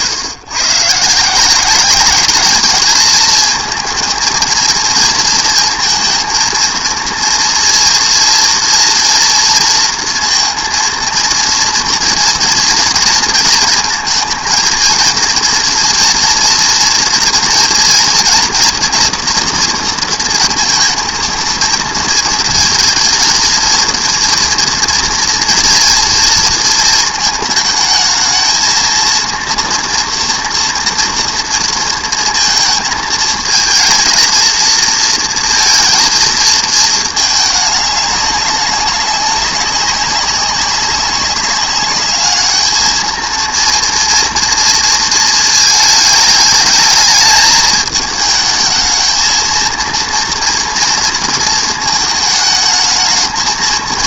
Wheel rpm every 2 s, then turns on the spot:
130, 210, 220, 230, 230, 230, 230, 230, 230, 230, 230, 230, 230, 220, 230, 230, 220, 230, 220, 190, 200, 220, 230, 220, 220, 230, 220.
none